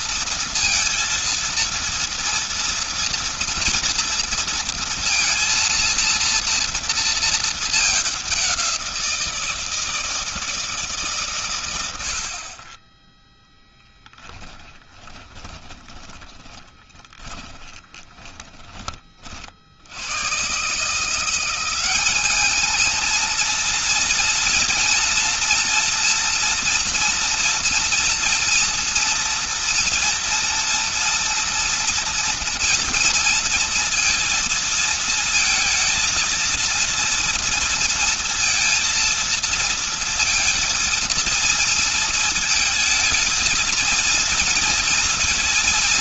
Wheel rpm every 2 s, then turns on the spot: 230, 230, 230, 230, 190, 160, 60, 20, 30, 20, 130, 210, 230, 240, 230, 230, 230, 230, 230, 230, 230, 220, 230.
14-20